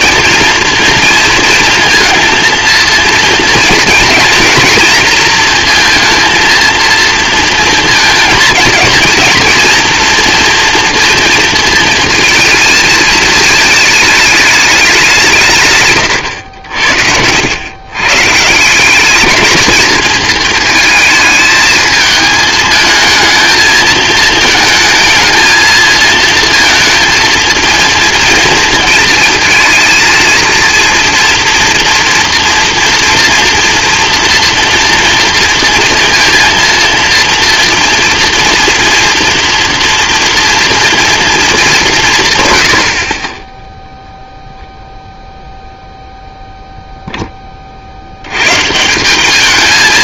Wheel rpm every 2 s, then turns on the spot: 230, 230, 230, 230, 230, 230, 230, 210, 110, 150, 220, 220, 220, 230, 230, 230, 230, 230, 230, 230, 230, 120, 0, 0, 140.
16-18